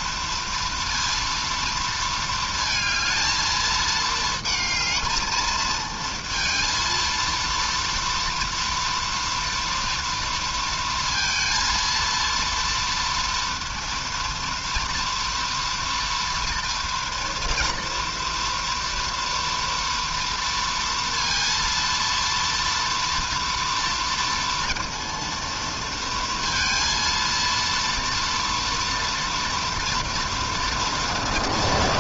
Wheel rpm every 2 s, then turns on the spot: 230, 220, 220, 230, 230, 230, 230, 230, 230, 230, 230, 230, 230, 230, 230, 230.
none